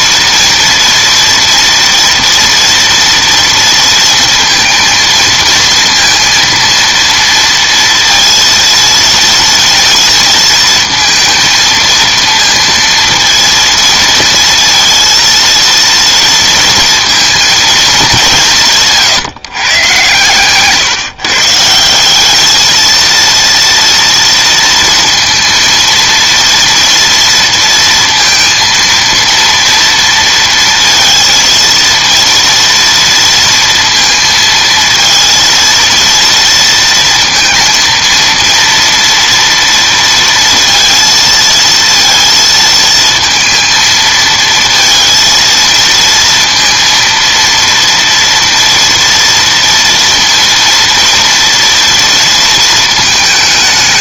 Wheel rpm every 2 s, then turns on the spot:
230, 230, 230, 230, 230, 230, 230, 230, 230, 170, 140, 220, 230, 230, 230, 230, 230, 230, 230, 230, 230, 230, 230, 230, 230, 230, 220.
none